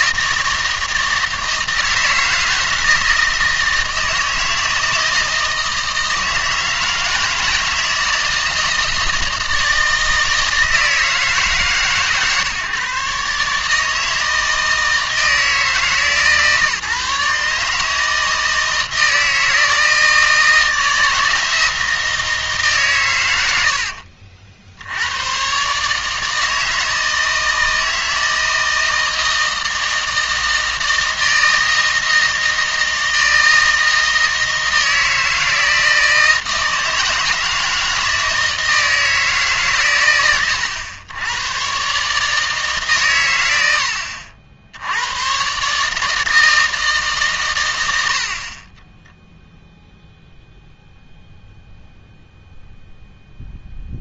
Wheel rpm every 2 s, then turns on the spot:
160, 160, 160, 160, 160, 160, 140, 160, 140, 160, 160, 150, 70, 160, 160, 160, 160, 160, 160, 160, 100, 150, 80, 160, 20, 0, 0.
none